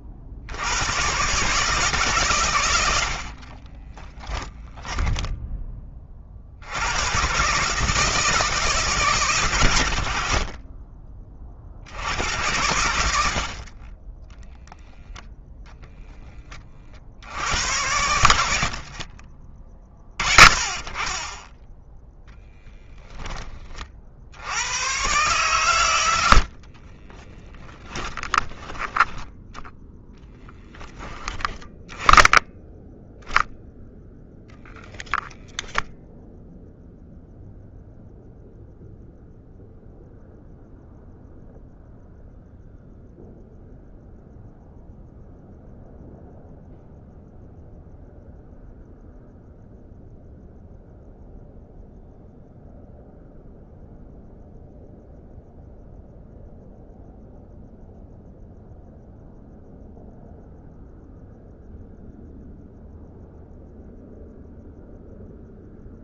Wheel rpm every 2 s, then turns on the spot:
110, 90, 10, 100, 150, 40, 90, 0, 50, 40, 30, 10, 110, 30, 10, 10, 10, 0, 0, 0, 0, 0, 0, 0, 0, 0, 0, 0, 0, 0, 0, 0, 0.
4-6 10-12 18-20 26-28